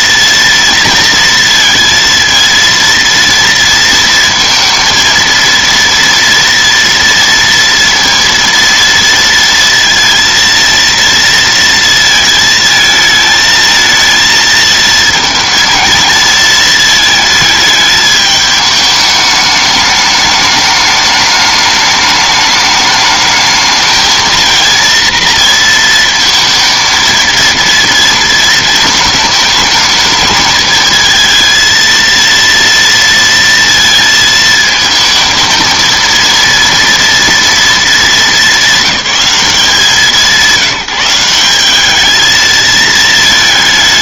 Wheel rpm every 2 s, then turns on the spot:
230, 230, 230, 230, 230, 230, 220, 220, 220, 210, 210, 210, 220, 220, 220, 220, 230, 220, 230, 210, 160, 220.
none